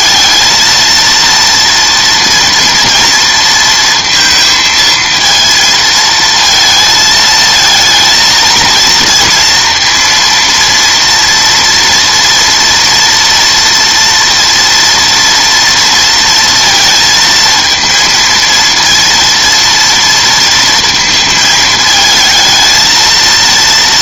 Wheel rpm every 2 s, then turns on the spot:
230, 230, 230, 230, 230, 230, 230, 230, 230, 230, 230, 220.
none